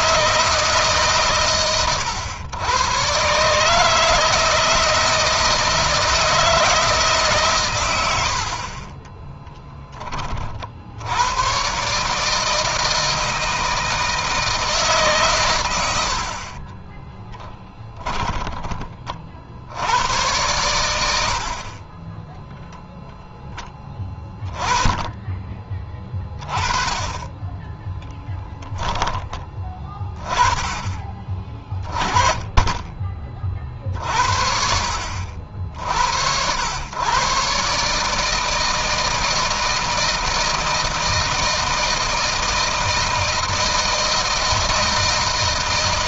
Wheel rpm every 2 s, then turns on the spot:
160, 110, 160, 160, 50, 60, 160, 150, 30, 30, 100, 0, 20, 20, 10, 20, 20, 60, 90, 160, 160, 160, 160.
8-10 16-18